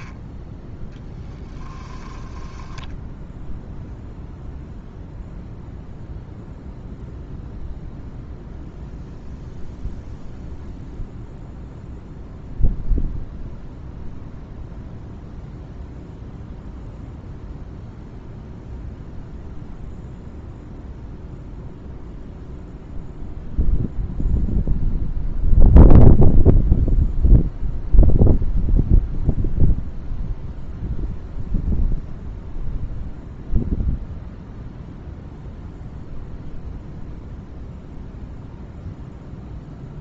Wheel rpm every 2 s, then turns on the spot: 10, 0, 0, 0, 0, 0, 0, 0, 0, 0, 0, 0, 0, 0, 0, 0, 0, 0, 0, 0.
none